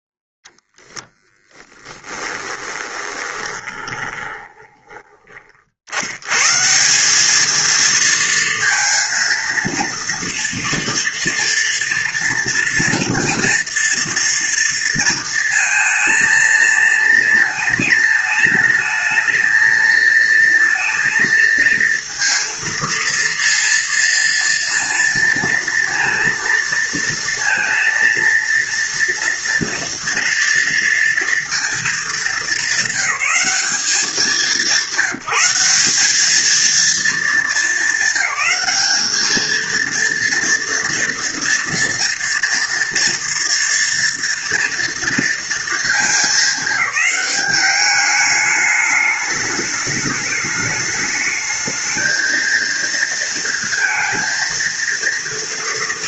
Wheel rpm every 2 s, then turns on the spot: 0, 20, 20, 130, 230, 230, 230, 230, 230, 220, 230, 230, 230, 230, 230, 230, 200, 200, 220, 220, 230, 230, 230, 210, 210, 210, 230, 230.
2-6